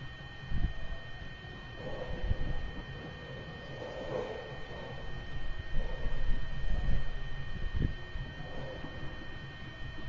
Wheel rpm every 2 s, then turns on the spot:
0, 0, 0, 0, 0.
none